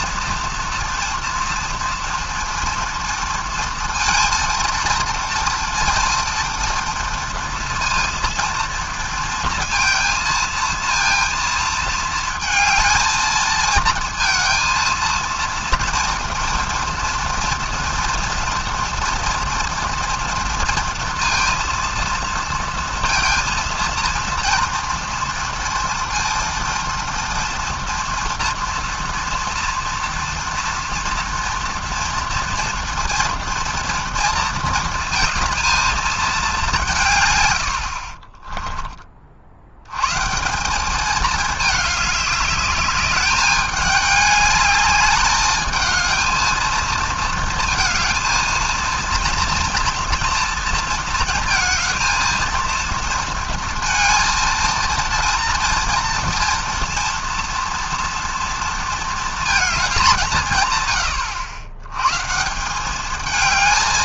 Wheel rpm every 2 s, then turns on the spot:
230, 240, 230, 230, 230, 230, 220, 230, 230, 240, 230, 230, 230, 230, 230, 230, 230, 230, 190, 20, 180, 200, 210, 220, 230, 230, 230, 230, 230, 230, 130, 170.
38-40